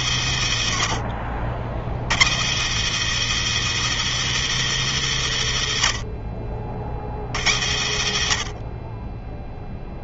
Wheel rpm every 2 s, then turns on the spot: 120, 100, 170, 50, 50.
none